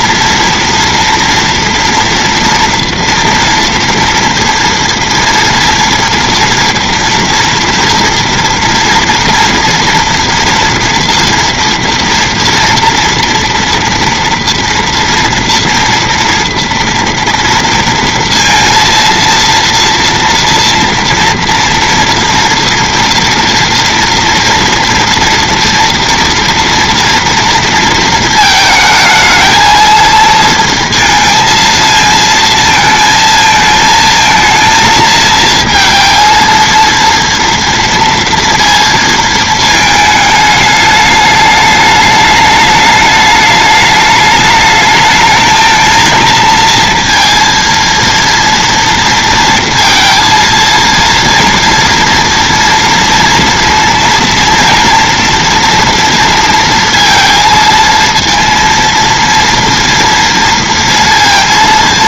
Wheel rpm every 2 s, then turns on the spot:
230, 230, 230, 230, 240, 240, 230, 230, 230, 230, 230, 240, 230, 230, 220, 230, 230, 230, 230, 230, 210, 210, 210, 230, 230, 230, 230, 230, 230, 230, 230.
none